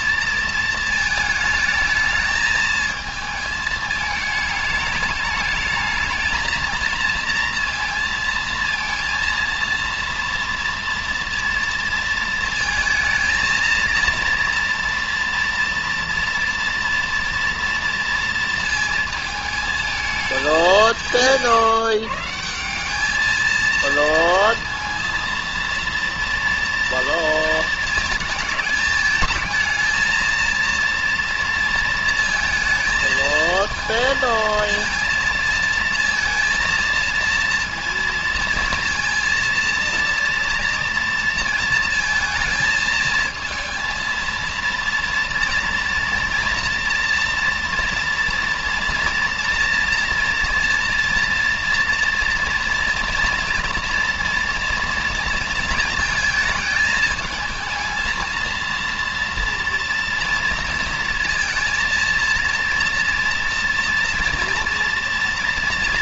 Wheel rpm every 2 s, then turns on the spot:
230, 220, 220, 220, 230, 230, 230, 230, 230, 230, 200, 160, 230, 230, 220, 230, 220, 230, 230, 230, 230, 220, 230, 230, 240, 230, 230, 230, 220, 230, 230, 230, 230.
none